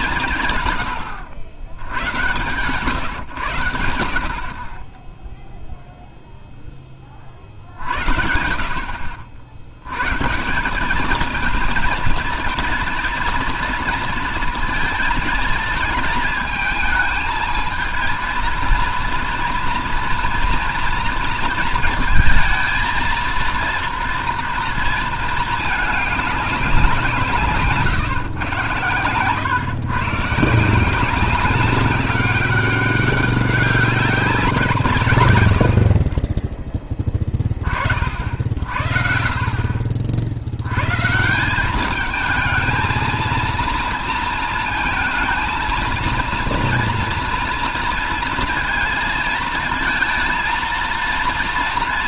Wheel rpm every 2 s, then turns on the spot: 130, 120, 40, 0, 70, 180, 220, 220, 220, 230, 230, 230, 230, 190, 120, 160, 200, 160, 20, 50, 90, 220, 220, 240, 230, 230.
none